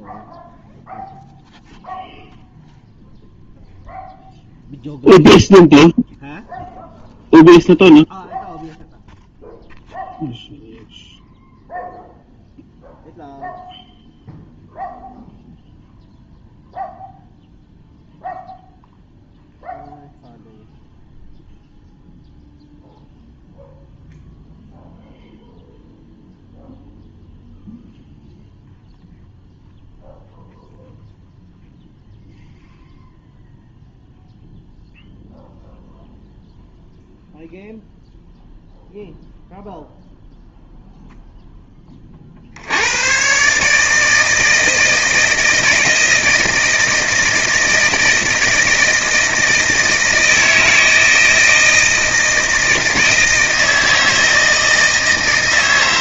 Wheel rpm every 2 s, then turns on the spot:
0, 0, 0, 0, 0, 0, 0, 0, 0, 0, 0, 0, 0, 0, 0, 0, 0, 0, 0, 0, 0, 70, 160, 160, 160, 160, 160, 160.
none